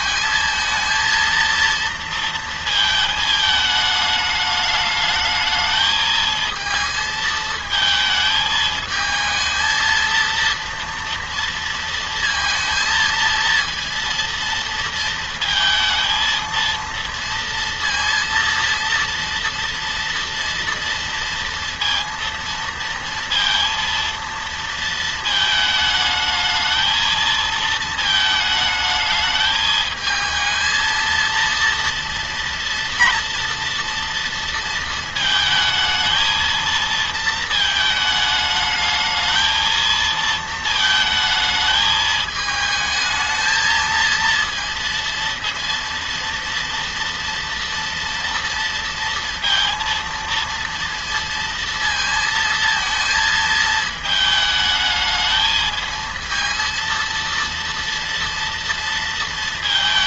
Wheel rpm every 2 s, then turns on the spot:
220, 230, 210, 220, 220, 230, 230, 230, 230, 230, 230, 230, 220, 220, 220, 220, 230, 230, 220, 220, 220, 220, 230, 230, 230, 230, 230, 220, 230, 230.
none